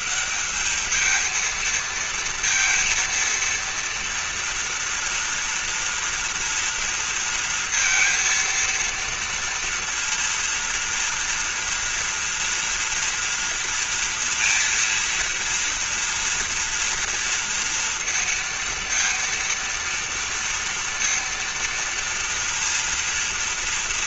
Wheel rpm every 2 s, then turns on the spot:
200, 230, 230, 230, 230, 230, 230, 230, 230, 230, 230, 230.
none